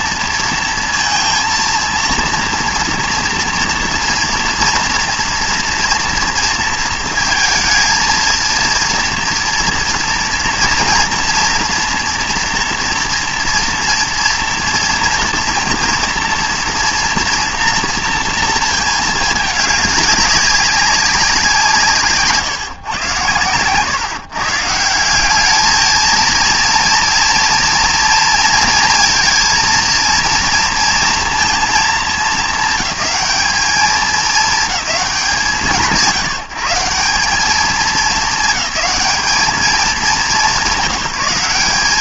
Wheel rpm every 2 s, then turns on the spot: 230, 240, 230, 230, 230, 230, 230, 230, 240, 230, 200, 140, 150, 230, 230, 230, 190, 220, 160, 200, 190.
none